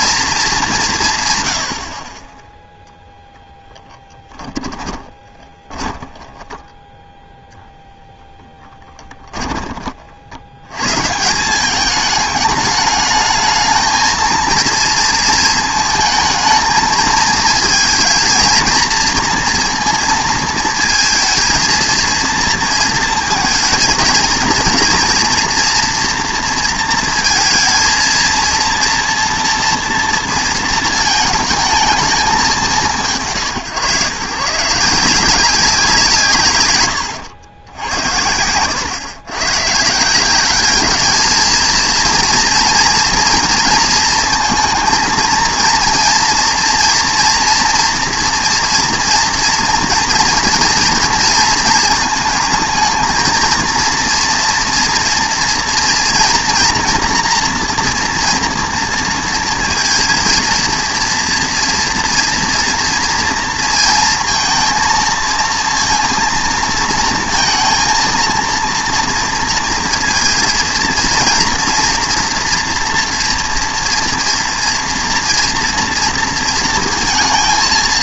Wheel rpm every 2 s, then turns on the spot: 220, 10, 10, 10, 20, 160, 210, 230, 220, 230, 220, 230, 230, 230, 230, 220, 110, 180, 100, 110, 220, 230, 230, 230, 230, 230, 230, 230, 240, 230, 230, 230, 230, 230, 230, 240, 230, 230, 230.
4-6 8-10